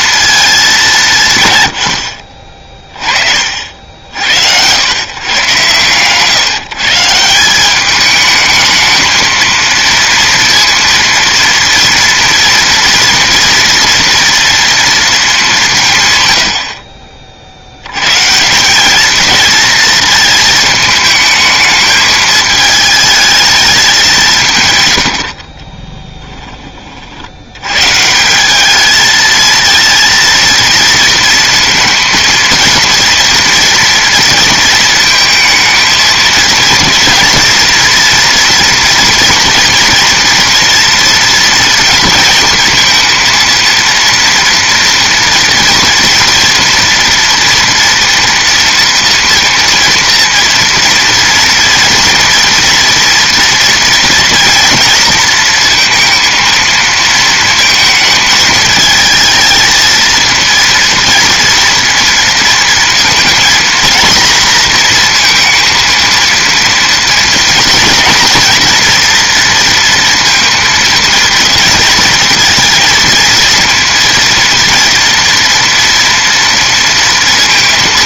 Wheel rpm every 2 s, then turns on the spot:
190, 30, 110, 150, 220, 230, 230, 230, 60, 190, 220, 220, 130, 30, 210, 230, 230, 230, 230, 230, 230, 230, 240, 230, 230, 240, 230, 230, 230, 220, 230, 230, 230, 230, 240, 230, 230, 230, 230.
none